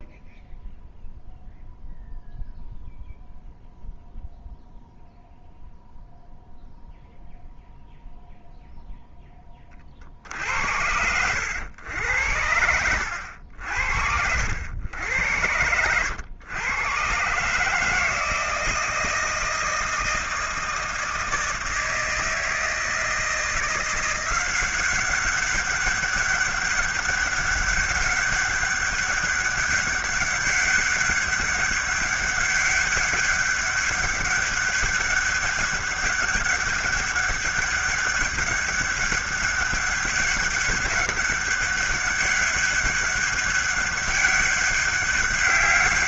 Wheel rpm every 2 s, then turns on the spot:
0, 0, 0, 0, 0, 60, 90, 80, 120, 160, 160, 160, 180, 200, 200, 200, 200, 200, 200, 200, 200, 200, 200.
none